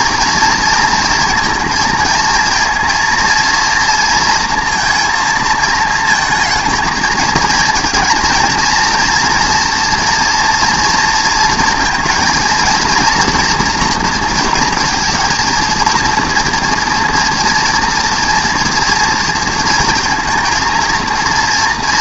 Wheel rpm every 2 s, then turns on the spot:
230, 230, 230, 220, 230, 230, 230, 230, 230, 230, 230.
none